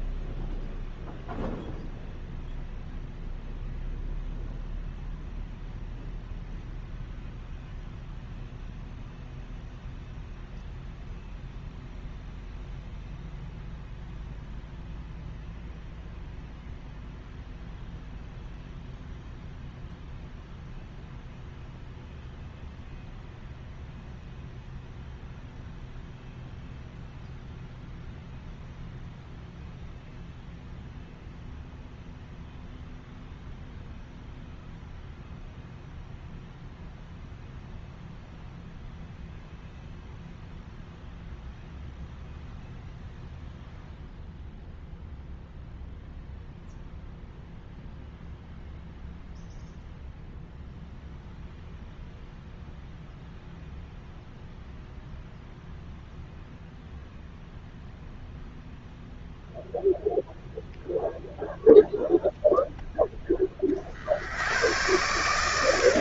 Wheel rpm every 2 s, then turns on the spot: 0, 0, 0, 0, 0, 0, 0, 0, 0, 0, 0, 0, 0, 0, 0, 0, 0, 0, 0, 0, 0, 0, 0, 0, 0, 0, 0, 0, 0, 0, 0, 0, 100.
none